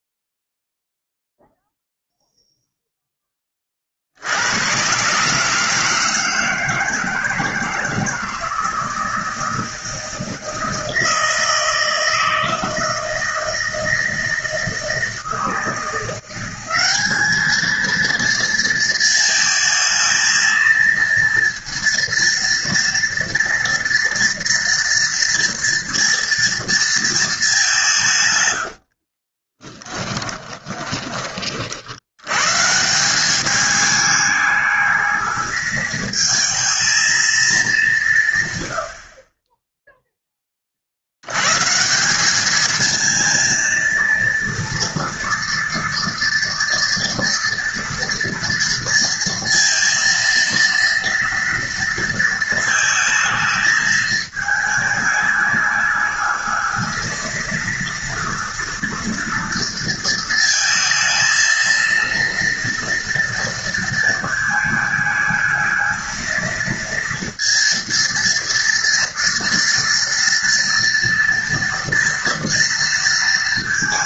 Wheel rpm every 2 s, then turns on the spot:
0, 0, 120, 160, 160, 160, 160, 160, 200, 220, 220, 230, 230, 230, 70, 20, 160, 210, 220, 80, 40, 220, 230, 230, 230, 230, 220, 210, 220, 240, 230, 230, 220, 230, 230, 230, 230.
28-32